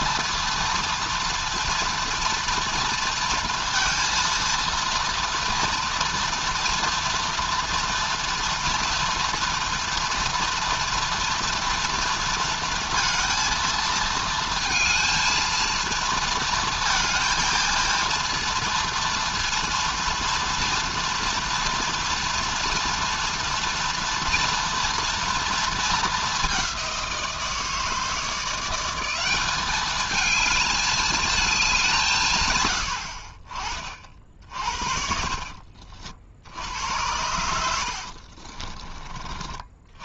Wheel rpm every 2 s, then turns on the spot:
230, 230, 230, 230, 240, 230, 230, 220, 230, 230, 230, 230, 240, 180, 180, 220, 80, 30, 90, 30.
none